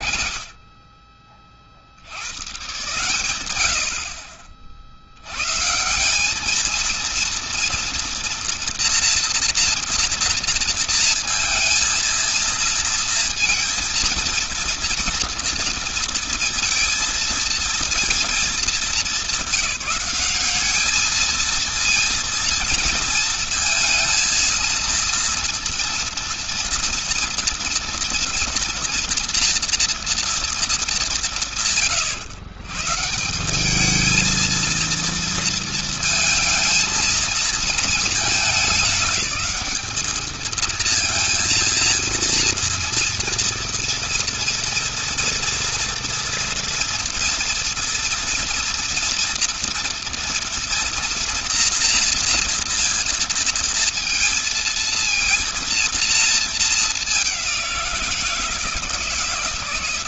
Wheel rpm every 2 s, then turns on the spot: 40, 120, 60, 200, 230, 230, 230, 230, 230, 220, 200, 230, 230, 240, 230, 230, 120, 230, 230, 220, 220, 230, 230, 230, 230, 230, 240, 230, 220, 170.
none